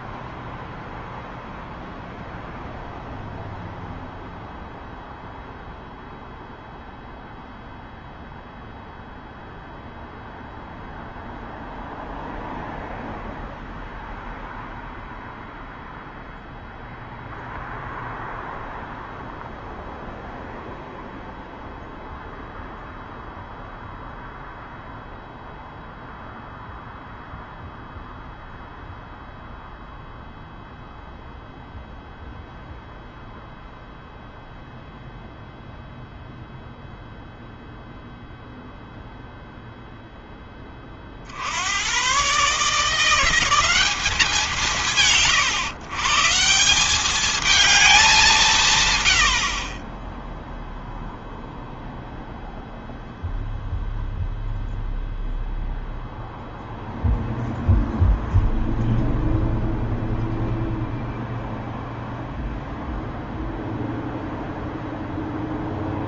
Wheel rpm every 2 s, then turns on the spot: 0, 0, 0, 0, 0, 0, 0, 0, 0, 0, 0, 0, 0, 0, 0, 0, 0, 0, 0, 0, 10, 130, 180, 170, 160, 0, 0, 0, 0, 0, 0, 0, 0.
none